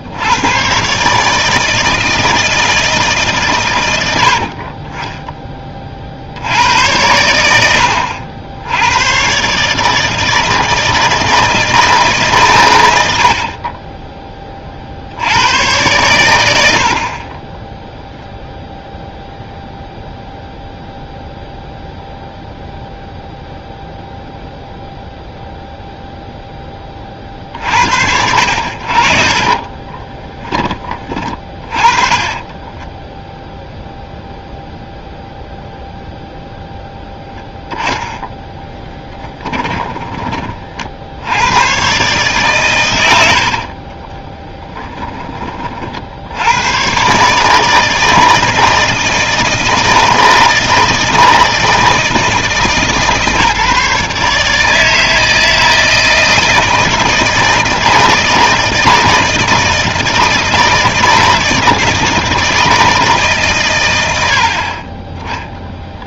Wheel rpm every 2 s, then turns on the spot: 150, 150, 20, 90, 110, 160, 90, 70, 40, 0, 0, 0, 0, 10, 60, 20, 10, 0, 0, 10, 50, 120, 20, 110, 160, 160, 150, 160, 160, 160, 160, 160, 40.
12-14 38-40